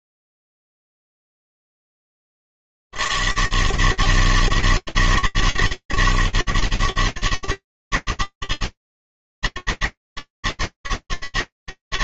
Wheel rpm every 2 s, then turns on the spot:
80, 160, 160, 150, 160, 160.
none